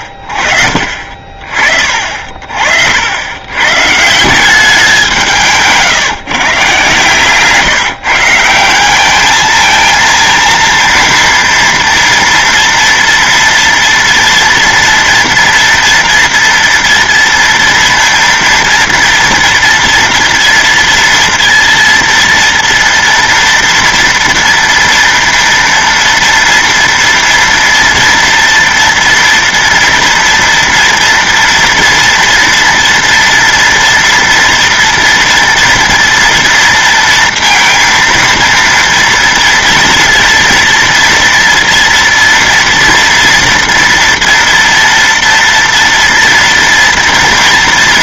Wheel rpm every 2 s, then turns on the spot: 50, 60, 190, 140, 180, 230, 230, 230, 230, 230, 230, 230, 230, 230, 230, 230, 230, 230, 230, 230, 230, 230, 230, 230.
0-2